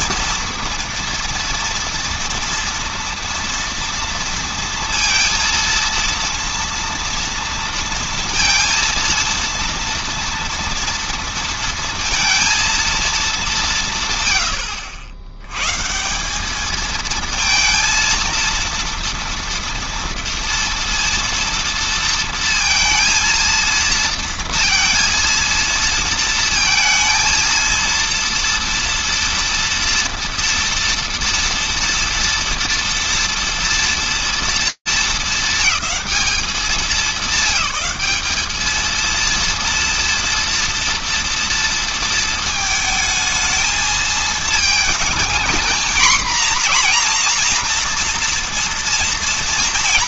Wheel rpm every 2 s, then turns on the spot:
230, 230, 230, 230, 230, 230, 210, 80, 220, 230, 230, 230, 230, 230, 230, 230, 230, 220, 200, 230, 230, 220, 220, 240, 230.
none